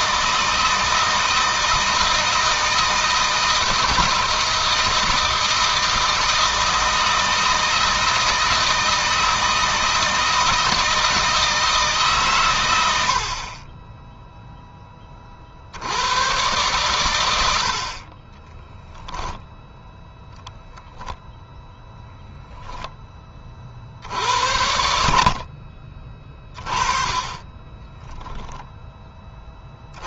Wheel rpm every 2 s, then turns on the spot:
160, 160, 160, 160, 160, 160, 80, 10, 110, 10, 0, 10, 60, 20, 20.
none